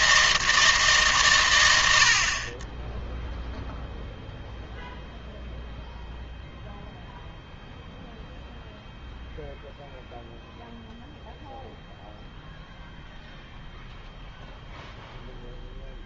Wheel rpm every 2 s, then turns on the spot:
160, 20, 0, 0, 0, 0, 0, 0.
none